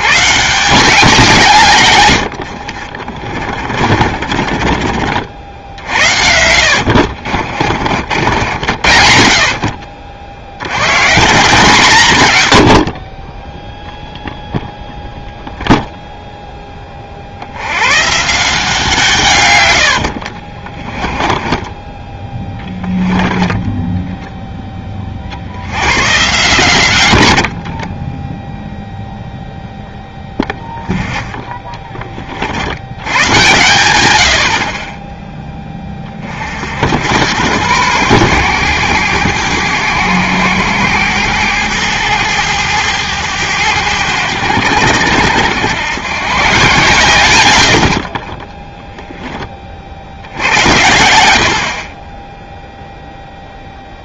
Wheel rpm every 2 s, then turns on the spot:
180, 50, 40, 70, 70, 100, 80, 0, 20, 150, 30, 10, 10, 110, 0, 10, 80, 40, 70, 110, 100, 100, 90, 140, 10, 70, 0.
2-4 6-8 20-24